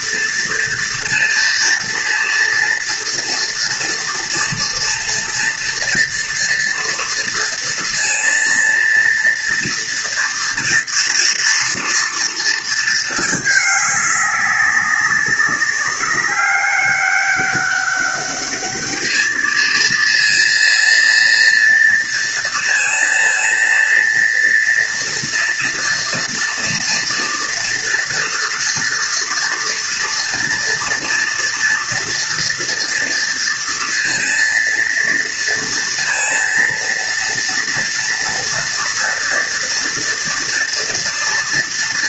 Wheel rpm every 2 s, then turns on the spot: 230, 230, 230, 230, 230, 230, 230, 200, 200, 210, 230, 230, 230, 230, 230, 230, 230, 230, 230, 230, 230.
none